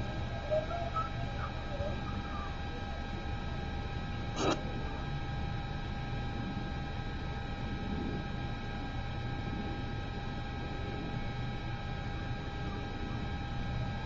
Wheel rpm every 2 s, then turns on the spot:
0, 0, 0, 0, 0, 0, 0.
none